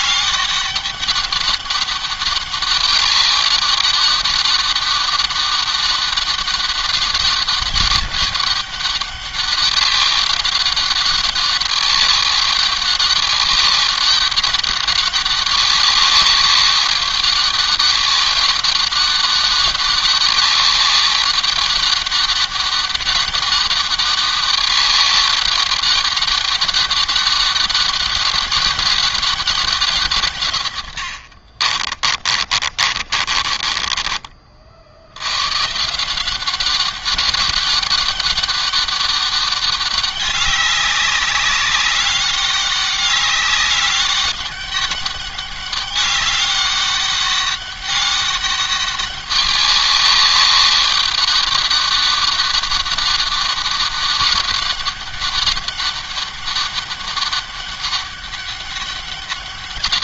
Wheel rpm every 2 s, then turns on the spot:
190, 200, 200, 200, 200, 190, 200, 200, 200, 200, 200, 190, 200, 200, 200, 90, 40, 80, 190, 200, 200, 200, 200, 200, 200, 200, 200, 200, 200, 200.
30-34